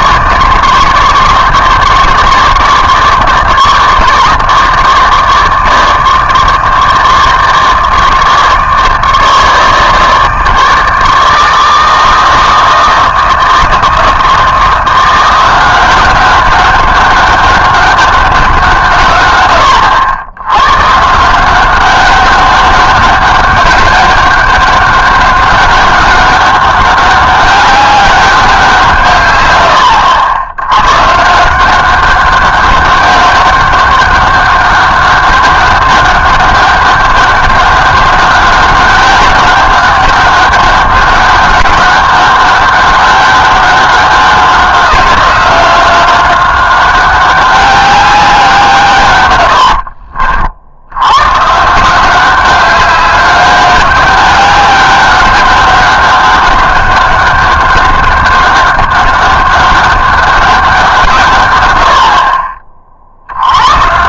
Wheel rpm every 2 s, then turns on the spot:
160, 150, 150, 150, 150, 160, 160, 170, 200, 170, 120, 200, 200, 200, 170, 100, 200, 200, 200, 200, 200, 200, 190, 190, 170, 70, 200, 200, 200, 200, 180, 40.
none